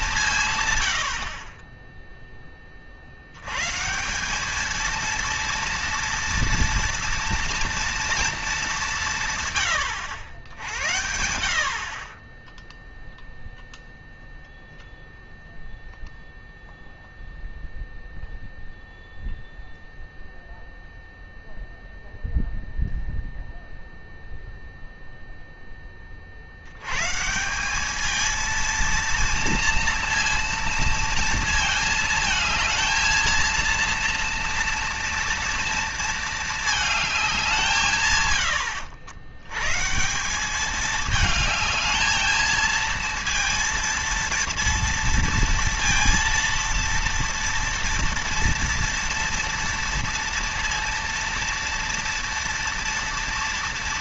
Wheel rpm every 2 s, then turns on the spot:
130, 20, 210, 230, 200, 70, 10, 0, 0, 0, 0, 0, 0, 80, 230, 230, 220, 230, 220, 90, 200, 220, 230, 230, 230, 230, 230.
none